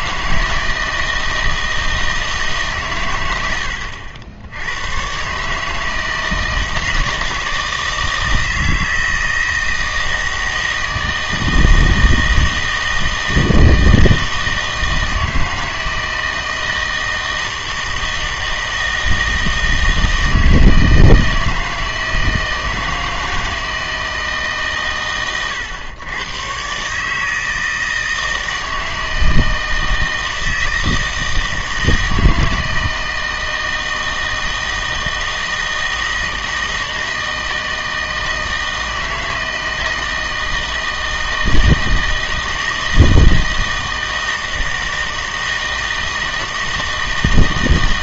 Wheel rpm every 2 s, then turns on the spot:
160, 130, 90, 160, 160, 160, 160, 160, 160, 160, 160, 160, 140, 130, 160, 160, 160, 160, 160, 160, 160, 160, 160, 160.
none